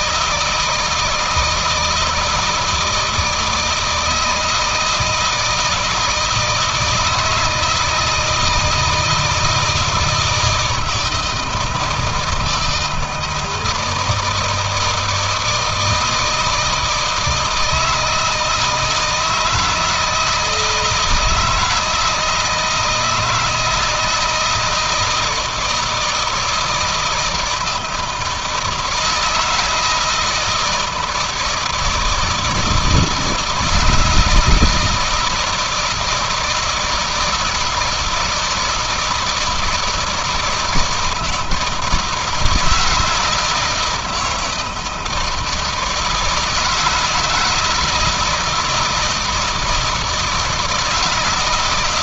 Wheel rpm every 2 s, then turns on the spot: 170, 160, 160, 160, 170, 170, 160, 160, 160, 160, 160, 160, 160, 160, 170, 160, 160, 160, 160, 160, 160, 160, 160, 160, 160, 160.
none